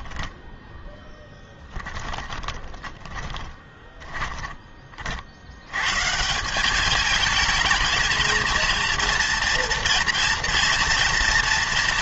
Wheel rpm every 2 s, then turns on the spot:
10, 20, 20, 190, 230, 230.
0-4